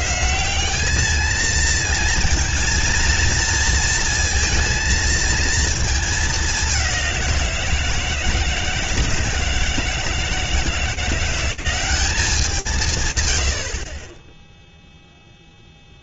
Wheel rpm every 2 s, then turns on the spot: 210, 230, 230, 200, 160, 160, 160, 0.
none